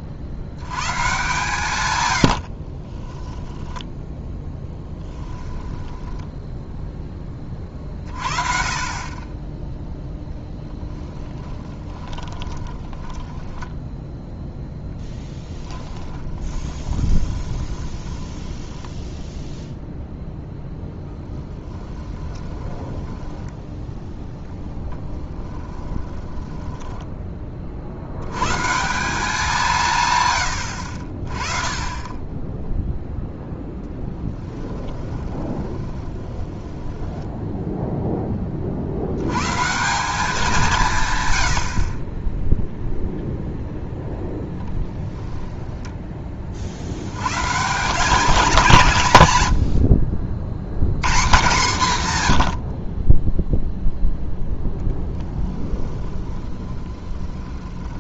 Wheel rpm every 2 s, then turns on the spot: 60, 40, 10, 0, 40, 10, 20, 10, 20, 10, 0, 10, 10, 20, 150, 80, 10, 10, 20, 40, 170, 0, 0, 50, 170, 100, 60, 10, 20.
2-6 10-14 16-20 22-28 34-38 56-58